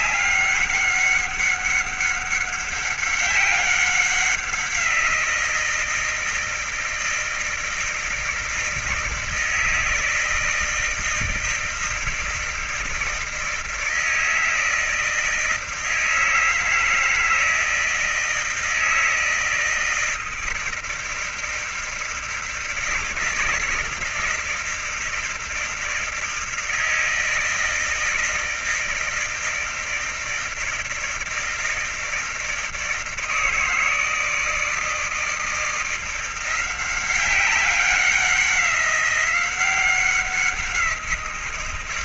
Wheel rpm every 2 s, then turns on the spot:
190, 190, 180, 160, 160, 160, 160, 160, 160, 160, 160, 160, 160, 160, 160, 160, 160, 160, 180, 190, 180.
none